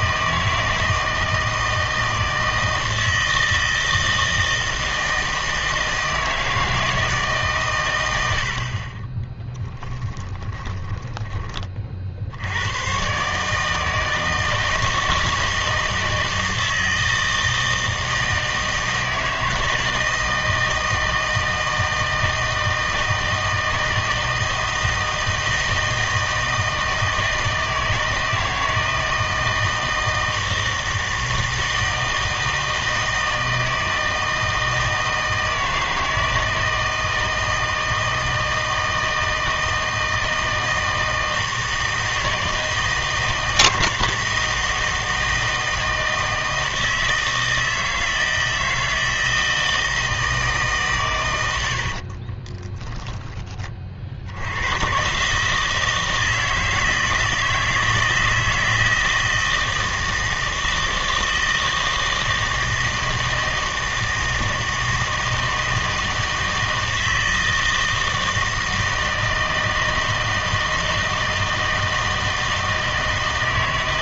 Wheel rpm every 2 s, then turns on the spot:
160, 160, 160, 160, 50, 20, 110, 160, 160, 160, 160, 160, 160, 160, 160, 160, 160, 160, 160, 160, 160, 160, 160, 160, 160, 140, 10, 100, 160, 160, 160, 160, 160, 160, 160, 160, 160.
10-12 52-54